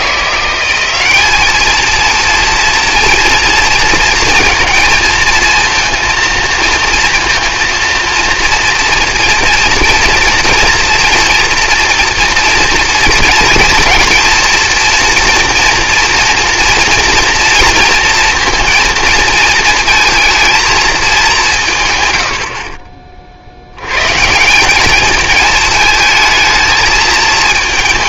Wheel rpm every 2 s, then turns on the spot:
190, 230, 230, 230, 230, 240, 230, 230, 230, 230, 220, 50, 190, 220.
none